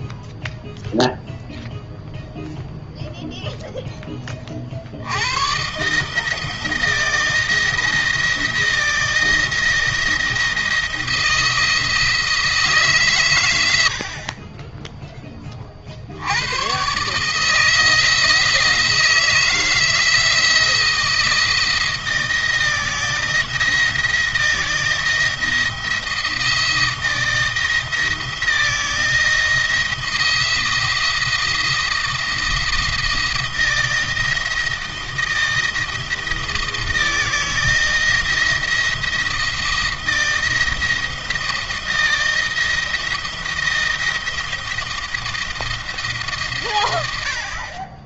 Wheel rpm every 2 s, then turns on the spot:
0, 0, 50, 160, 160, 170, 150, 20, 100, 160, 170, 170, 170, 160, 170, 170, 170, 170, 170, 160, 170, 170, 170, 130.
none